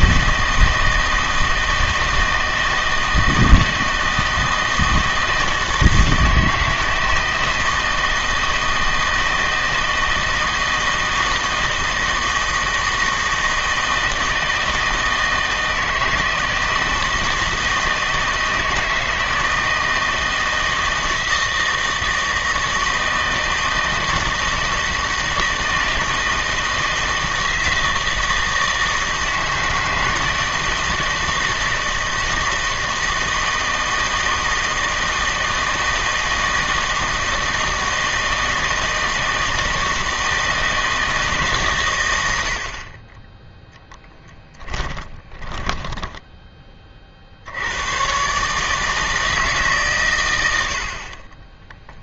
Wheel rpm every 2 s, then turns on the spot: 160, 160, 160, 160, 160, 160, 160, 160, 160, 160, 160, 160, 160, 160, 160, 160, 160, 160, 160, 160, 160, 50, 20, 30, 150, 70.
44-46